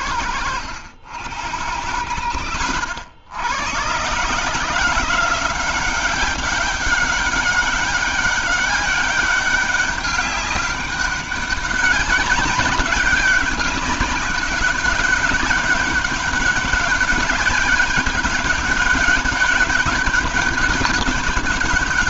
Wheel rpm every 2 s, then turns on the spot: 90, 90, 150, 190, 200, 200, 190, 190, 200, 190, 200.
none